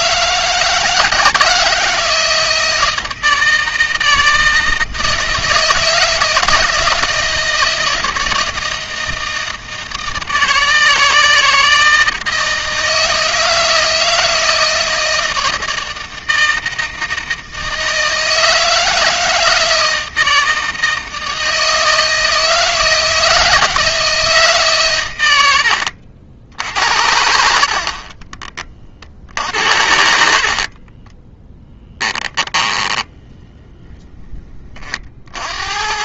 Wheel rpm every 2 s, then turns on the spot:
160, 160, 160, 160, 160, 160, 160, 160, 160, 160, 160, 160, 120, 70, 40, 30, 10, 30.
26-28 30-34